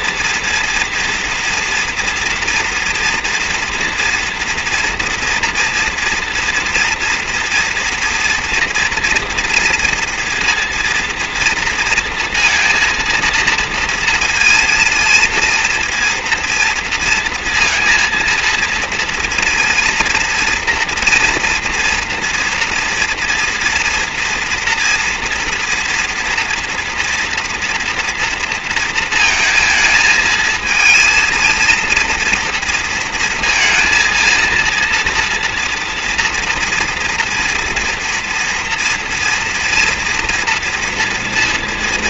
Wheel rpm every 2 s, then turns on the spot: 230, 230, 230, 230, 240, 230, 230, 230, 230, 230, 230, 240, 230, 240, 230, 230, 230, 230, 230, 230, 230.
none